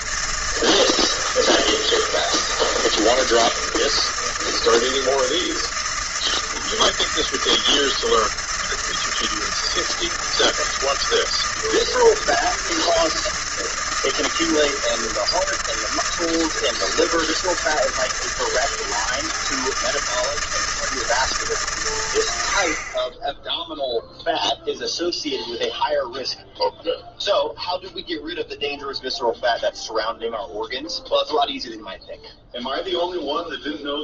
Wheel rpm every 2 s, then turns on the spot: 160, 160, 160, 160, 160, 160, 160, 160, 160, 160, 160, 70, 0, 0, 0, 0, 0.
none